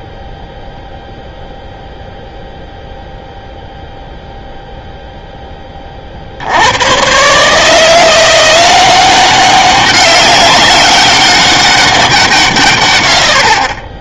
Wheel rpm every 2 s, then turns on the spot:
0, 0, 0, 90, 180, 200, 100.
none